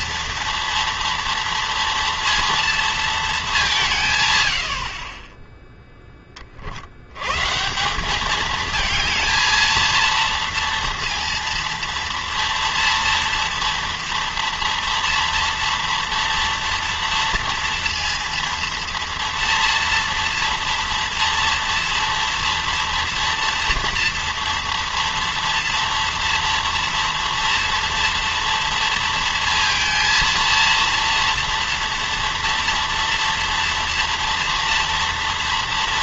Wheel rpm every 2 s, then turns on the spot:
230, 230, 120, 20, 200, 230, 230, 230, 240, 230, 230, 230, 230, 240, 230, 230, 230, 230.
none